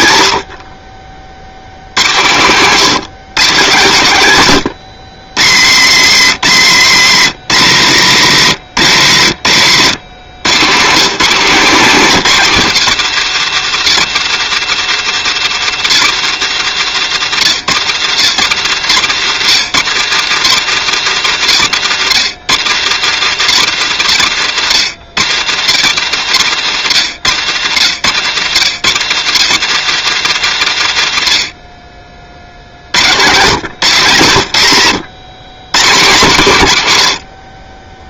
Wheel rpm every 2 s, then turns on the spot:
50, 170, 120, 120, 100, 170, 160, 150, 130, 110, 130, 130, 110, 100, 110, 100, 80, 120, 90.
none